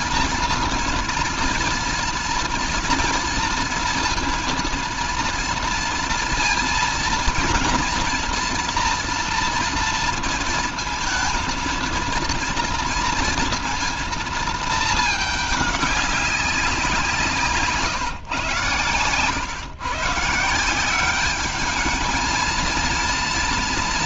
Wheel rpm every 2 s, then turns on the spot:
230, 230, 230, 230, 240, 230, 230, 220, 180, 120, 160, 230.
none